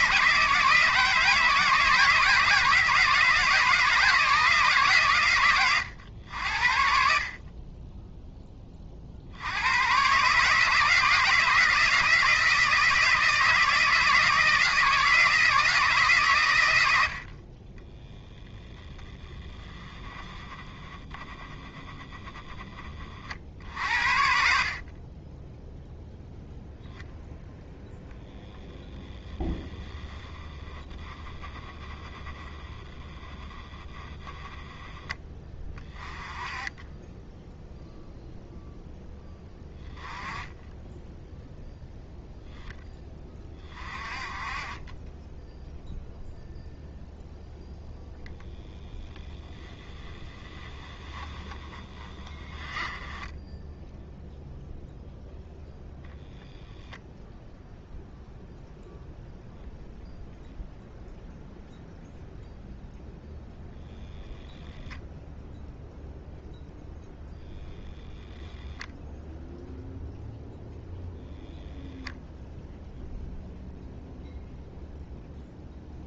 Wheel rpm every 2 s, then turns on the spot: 160, 160, 150, 80, 10, 150, 160, 160, 100, 10, 10, 10, 50, 0, 0, 10, 10, 10, 20, 0, 10, 10, 30, 0, 10, 10, 10, 0, 0, 0, 0, 0, 0, 0, 10, 0, 0, 0.
50-54